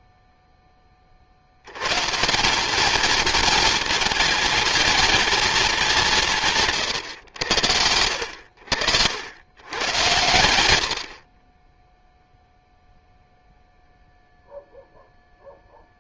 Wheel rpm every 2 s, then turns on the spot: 20, 200, 230, 160, 70, 80, 0, 0.
6-8